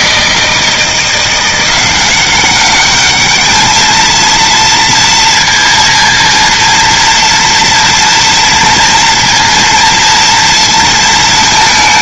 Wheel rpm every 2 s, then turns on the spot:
160, 210, 230, 230, 230, 230.
none